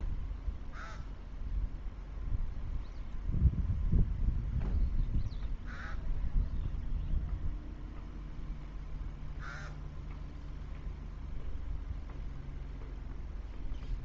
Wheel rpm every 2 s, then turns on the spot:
0, 0, 0, 0, 0, 0, 0.
none